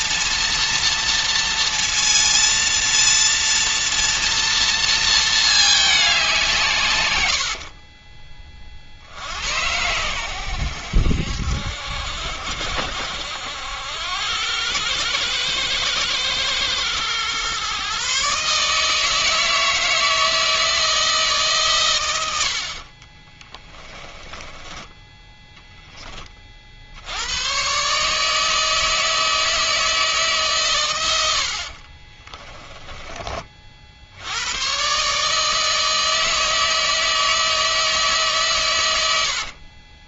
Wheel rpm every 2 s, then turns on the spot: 230, 230, 230, 150, 40, 80, 70, 100, 110, 150, 160, 60, 20, 50, 160, 130, 10, 110, 160, 120.
22-26 32-34